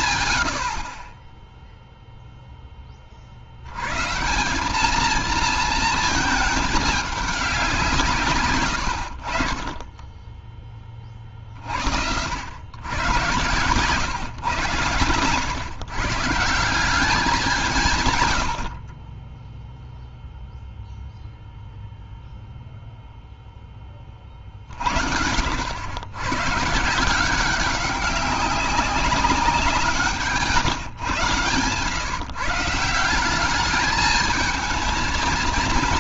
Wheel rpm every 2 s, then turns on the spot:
60, 10, 200, 210, 100, 20, 110, 120, 190, 50, 0, 0, 40, 150, 200, 140, 160, 220.
none